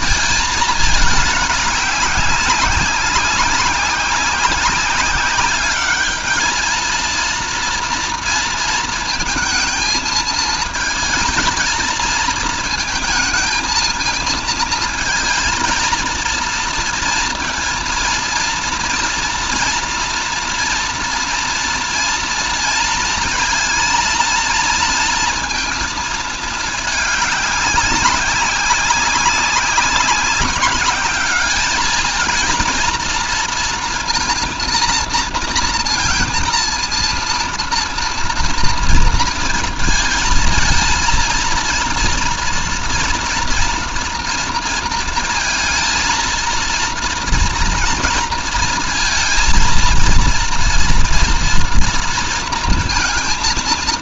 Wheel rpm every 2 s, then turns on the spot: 210, 200, 200, 230, 220, 230, 230, 220, 230, 230, 230, 230, 230, 200, 190, 200, 230, 230, 230, 230, 230, 230, 230, 230, 220, 230, 220.
none